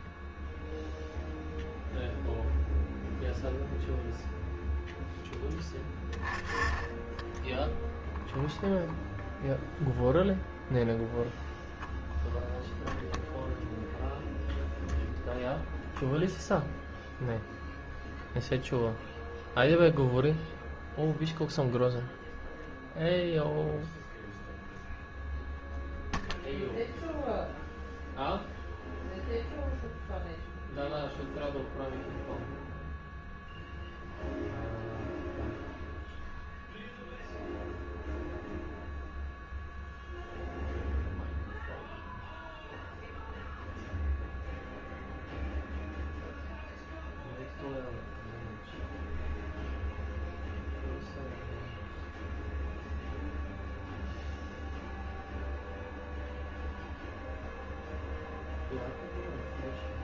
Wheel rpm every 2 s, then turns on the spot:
0, 0, 0, 10, 0, 0, 0, 0, 0, 0, 0, 0, 0, 0, 0, 0, 0, 0, 0, 0, 0, 0, 0, 0, 0, 0, 0, 0, 0, 0.
none